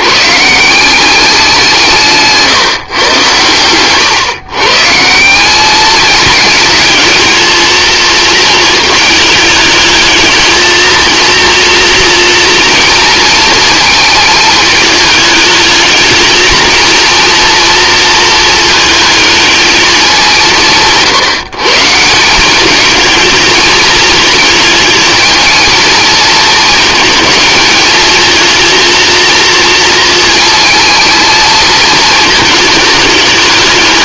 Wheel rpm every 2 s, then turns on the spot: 190, 120, 160, 220, 220, 230, 230, 220, 230, 220, 160, 210, 220, 220, 230, 230, 210.
none